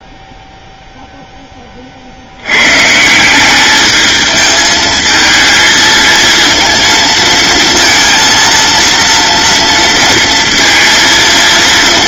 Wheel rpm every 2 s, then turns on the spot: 0, 100, 220, 230, 230, 230.
none